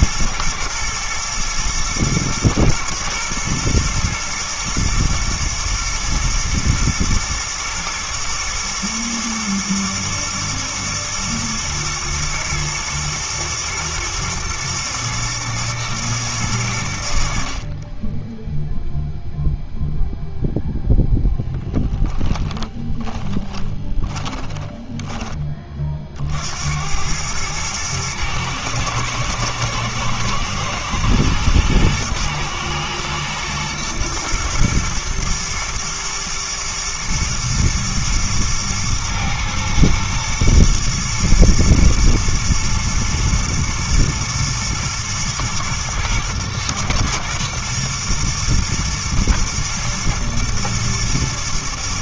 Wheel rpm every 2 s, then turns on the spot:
120, 120, 120, 120, 110, 120, 110, 120, 70, 0, 0, 10, 20, 90, 110, 110, 110, 120, 110, 110, 120, 120, 120, 110, 120, 120.
22-26